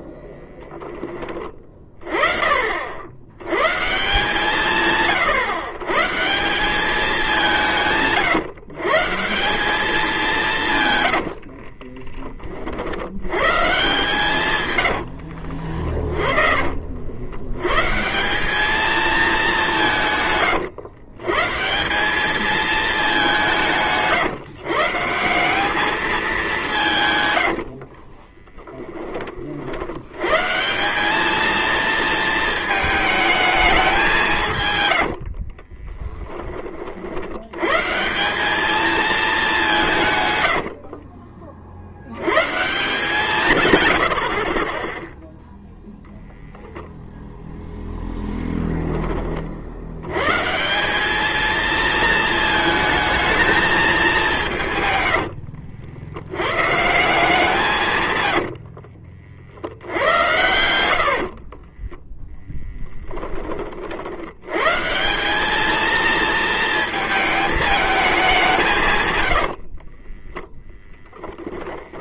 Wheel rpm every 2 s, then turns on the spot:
10, 50, 160, 180, 130, 170, 30, 130, 40, 190, 120, 210, 140, 180, 10, 140, 220, 140, 30, 210, 90, 140, 40, 0, 10, 150, 220, 160, 120, 90, 100, 10, 110, 220, 170, 10.
14-18 28-30 34-36 40-42 58-64 70-72